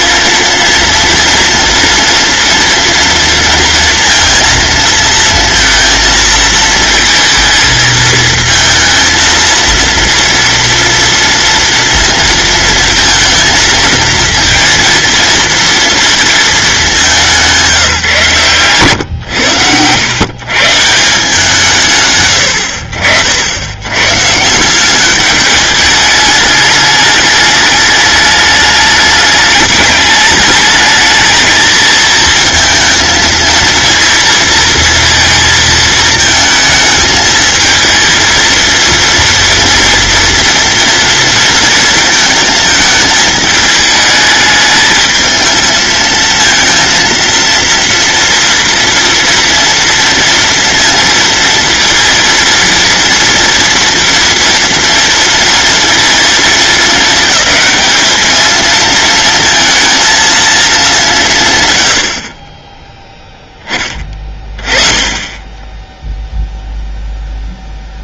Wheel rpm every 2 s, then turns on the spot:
230, 240, 230, 230, 220, 230, 230, 230, 220, 120, 150, 70, 180, 210, 210, 210, 220, 230, 220, 230, 230, 220, 210, 230, 230, 230, 230, 230, 220, 230, 220, 20, 20, 0.
18-20